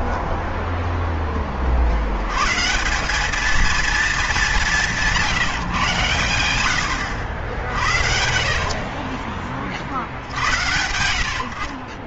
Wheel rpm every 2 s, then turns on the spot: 0, 150, 200, 100, 60, 80.
none